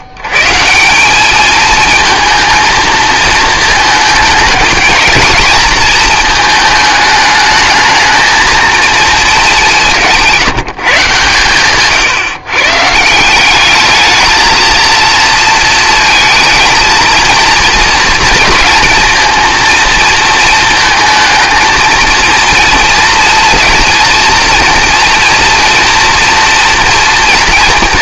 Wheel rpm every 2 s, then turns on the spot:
110, 220, 220, 220, 220, 150, 140, 230, 220, 230, 230, 230, 230, 230.
none